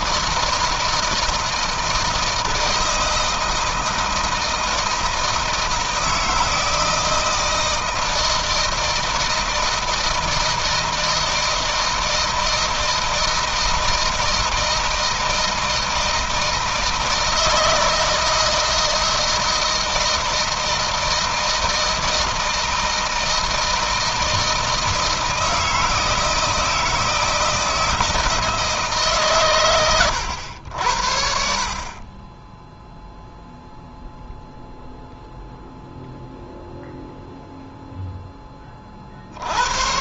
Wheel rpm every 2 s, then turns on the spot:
160, 160, 160, 160, 160, 160, 160, 160, 160, 160, 160, 160, 160, 160, 150, 80, 10, 0, 0, 30.
none